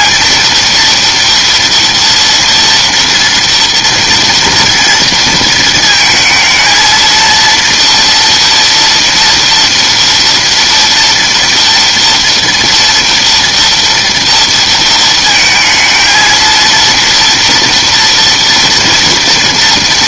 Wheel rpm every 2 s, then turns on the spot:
230, 230, 230, 220, 230, 230, 230, 230, 230, 240.
none